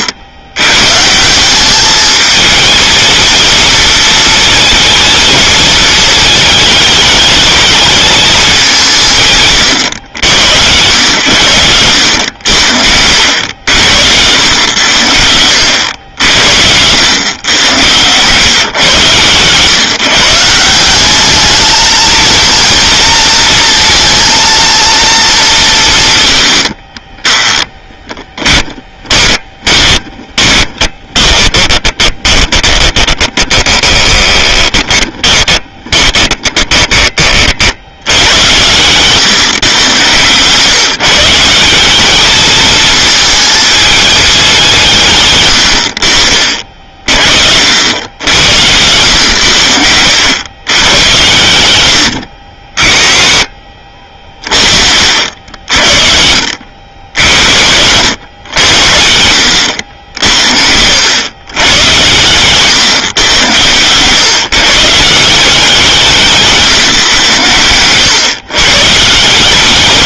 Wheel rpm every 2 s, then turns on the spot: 130, 220, 230, 220, 180, 100, 80, 90, 100, 130, 180, 230, 230, 60, 20, 20, 10, 20, 20, 120, 150, 220, 170, 50, 90, 110, 50, 40, 70, 80, 80, 120, 140, 160, 140.
28-38